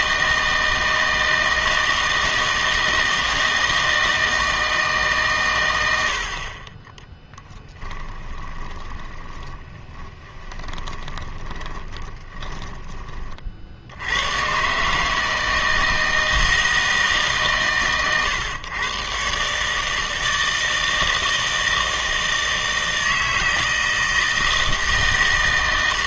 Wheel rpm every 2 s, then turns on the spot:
160, 160, 160, 20, 20, 20, 20, 140, 160, 120, 160, 160, 160.
8-14